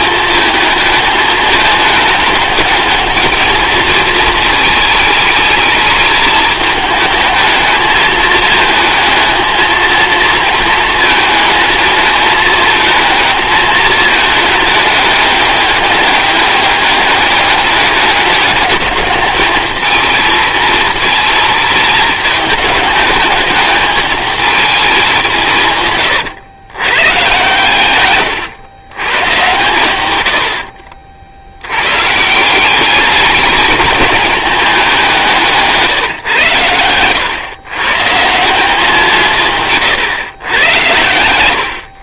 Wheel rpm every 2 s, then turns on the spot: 220, 210, 220, 220, 220, 230, 220, 210, 210, 210, 230, 210, 210, 110, 120, 60, 190, 210, 110, 190, 110.
30-32